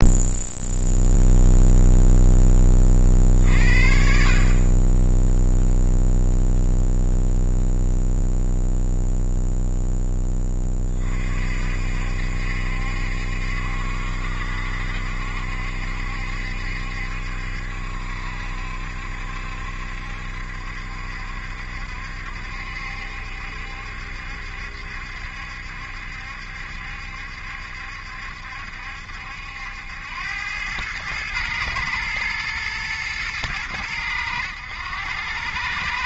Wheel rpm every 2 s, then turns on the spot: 0, 30, 30, 0, 0, 30, 70, 70, 70, 70, 70, 70, 70, 70, 70, 100, 120, 100.
none